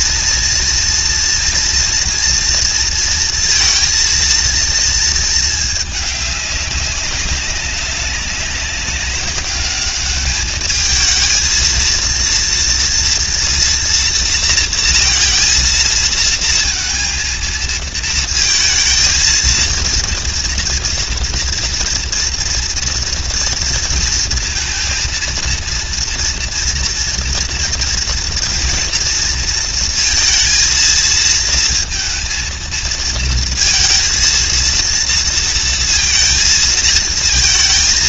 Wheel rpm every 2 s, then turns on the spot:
240, 230, 220, 190, 200, 220, 230, 230, 230, 230, 230, 230, 230, 240, 230, 230, 230, 230, 230.
none